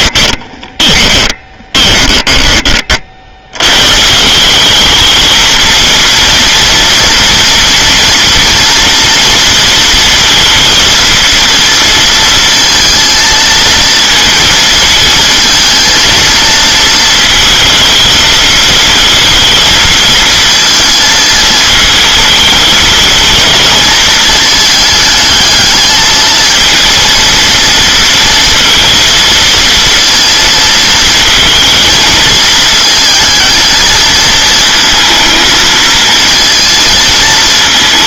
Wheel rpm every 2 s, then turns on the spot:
20, 30, 200, 230, 230, 230, 230, 230, 230, 220, 230, 220, 220, 230, 230, 230, 220, 230, 220.
0-2